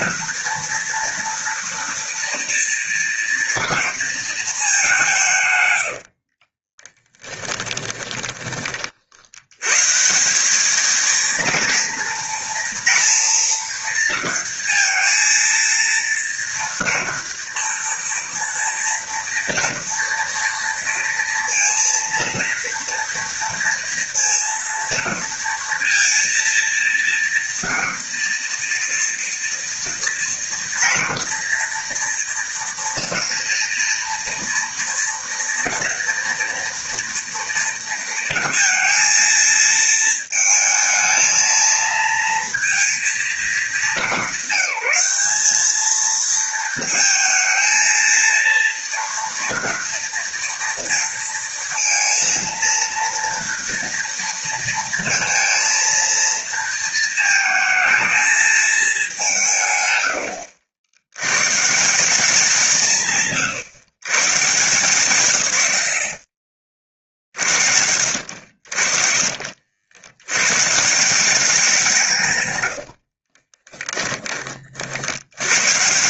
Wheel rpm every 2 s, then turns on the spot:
240, 230, 190, 20, 60, 220, 230, 230, 230, 230, 230, 230, 230, 230, 230, 230, 230, 230, 230, 230, 220, 220, 200, 220, 230, 230, 230, 230, 220, 190, 90, 160, 140, 60, 50, 170, 60, 80.
6-8 72-74